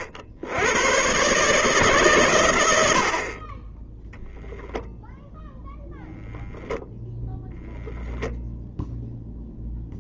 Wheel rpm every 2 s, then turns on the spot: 90, 110, 0, 0, 0.
none